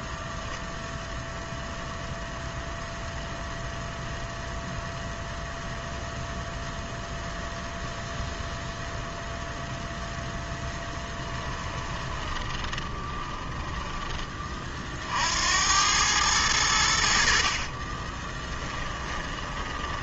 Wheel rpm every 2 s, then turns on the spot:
0, 0, 0, 0, 0, 10, 20, 40, 90, 10.
12-14 18-20